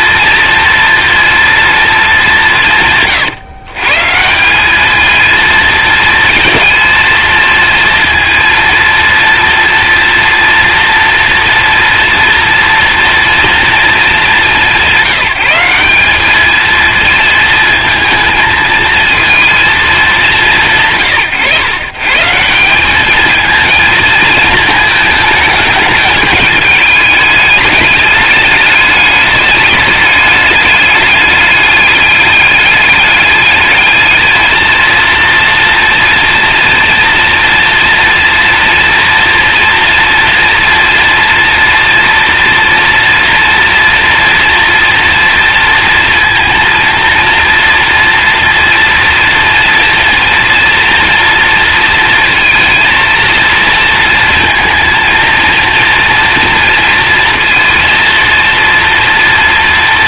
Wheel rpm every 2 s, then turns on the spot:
240, 150, 210, 220, 230, 230, 230, 180, 220, 220, 150, 200, 220, 210, 200, 200, 210, 230, 230, 230, 230, 230, 240, 230, 230, 230, 230, 230, 230, 230.
none